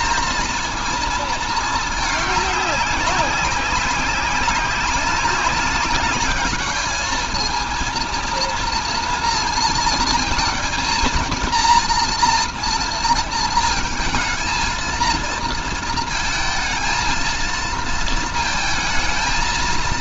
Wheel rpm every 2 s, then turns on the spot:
230, 200, 190, 210, 230, 220, 230, 230, 230, 220.
none